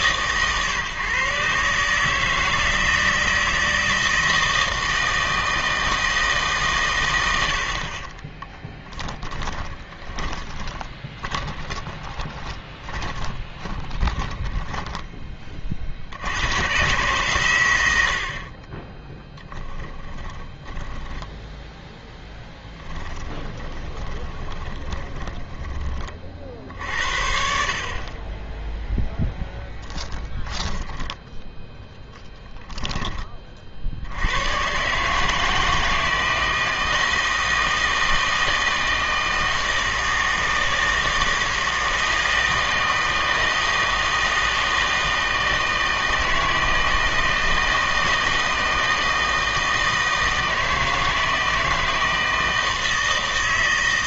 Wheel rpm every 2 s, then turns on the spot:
140, 160, 160, 130, 10, 20, 30, 10, 110, 40, 10, 10, 20, 60, 10, 10, 10, 130, 160, 160, 160, 160, 160, 160, 160, 160, 160.
8-16 20-26